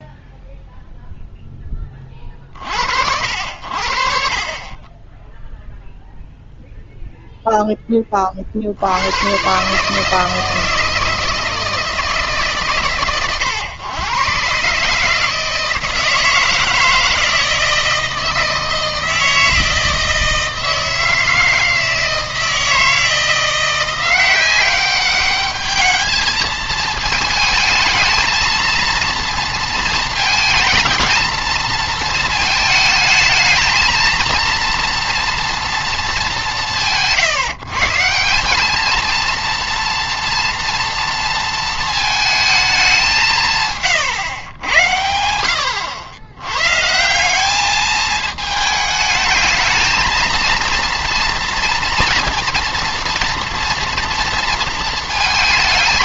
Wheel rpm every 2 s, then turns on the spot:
0, 50, 30, 0, 50, 160, 130, 140, 160, 160, 160, 160, 190, 220, 230, 220, 220, 230, 140, 210, 230, 210, 100, 130, 220, 230, 230, 230.
none